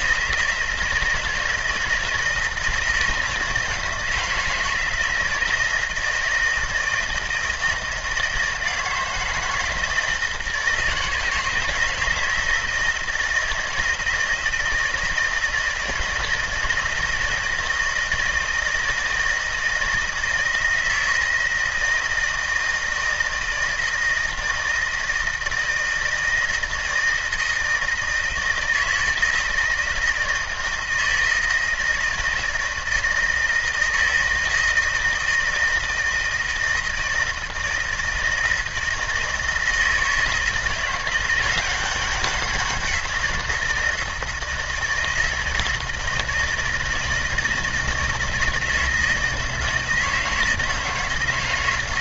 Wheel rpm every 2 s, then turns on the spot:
170, 160, 160, 160, 160, 160, 170, 160, 160, 160, 160, 160, 160, 160, 160, 160, 160, 160, 160, 160, 170, 190, 160, 160, 170, 160.
none